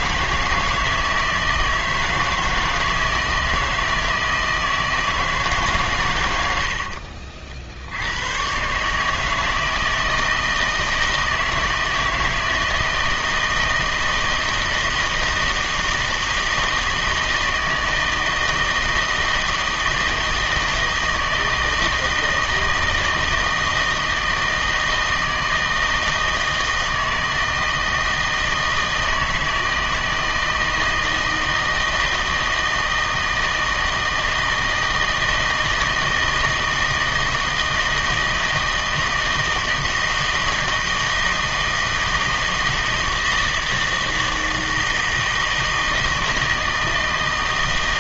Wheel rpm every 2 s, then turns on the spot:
160, 160, 160, 90, 130, 160, 160, 160, 160, 160, 160, 160, 160, 160, 160, 160, 160, 160, 160, 160, 160, 160, 160, 160.
6-8